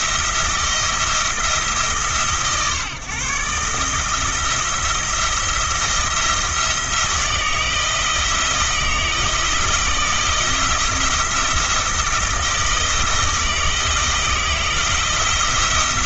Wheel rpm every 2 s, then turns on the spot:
170, 130, 170, 170, 160, 160, 160, 160.
none